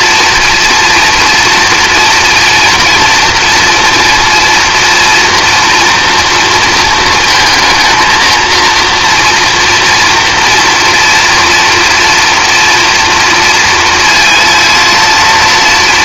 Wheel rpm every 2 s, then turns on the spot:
240, 240, 240, 230, 230, 240, 230, 230.
none